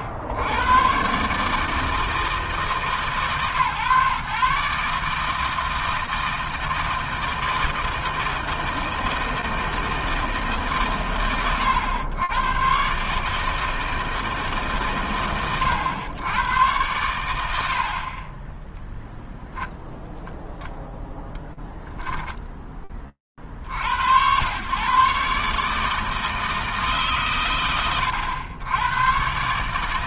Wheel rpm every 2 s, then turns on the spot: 80, 160, 140, 160, 160, 140, 110, 150, 110, 40, 0, 30, 120, 140, 80.
18-20